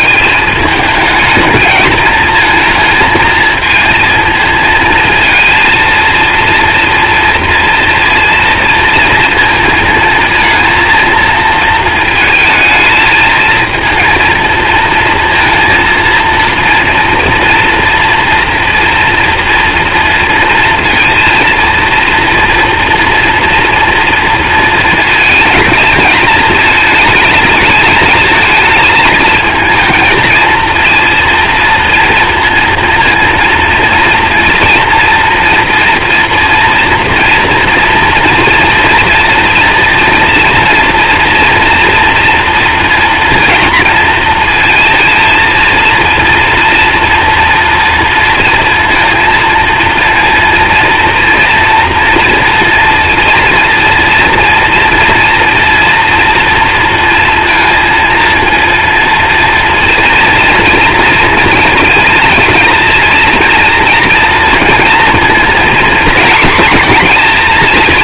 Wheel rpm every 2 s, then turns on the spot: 220, 230, 220, 230, 230, 230, 220, 230, 230, 230, 230, 230, 230, 220, 220, 230, 230, 230, 230, 230, 240, 230, 230, 230, 230, 230, 230, 230, 230, 230, 230, 230, 230, 240.
none